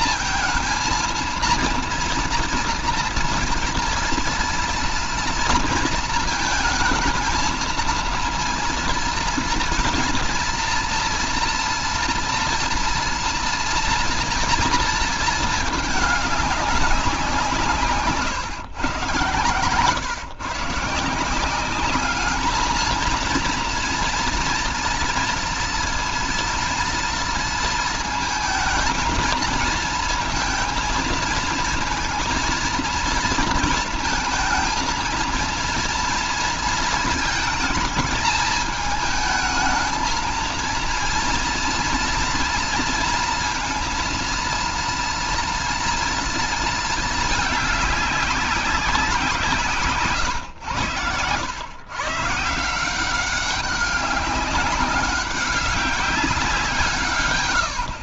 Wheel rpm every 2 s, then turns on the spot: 230, 230, 230, 220, 230, 230, 230, 230, 200, 130, 150, 220, 230, 230, 220, 230, 230, 220, 230, 210, 230, 230, 230, 230, 190, 100, 170, 200, 160.
none